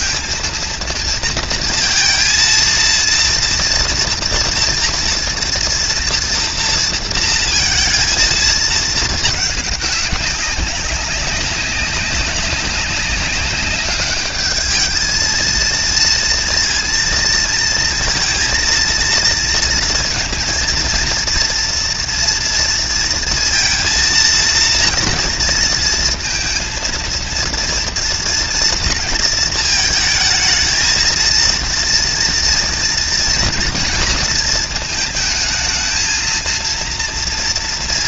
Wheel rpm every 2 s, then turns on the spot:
230, 230, 230, 230, 220, 190, 190, 210, 230, 230, 230, 230, 230, 230, 230, 220, 230, 220, 230.
none